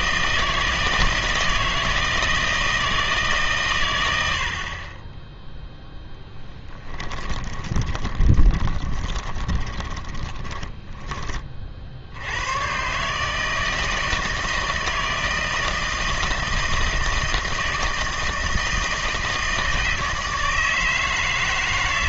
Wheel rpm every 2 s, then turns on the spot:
160, 160, 40, 10, 20, 10, 120, 160, 160, 160, 160.
6-12